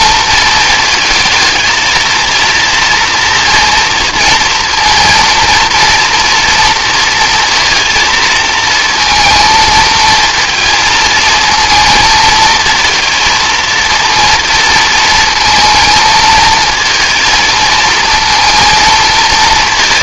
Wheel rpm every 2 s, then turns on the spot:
220, 230, 230, 230, 230, 220, 230, 220, 230, 230.
none